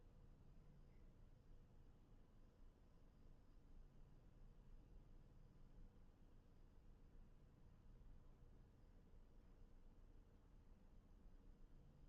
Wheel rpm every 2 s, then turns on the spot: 0, 0, 0, 0, 0, 0.
none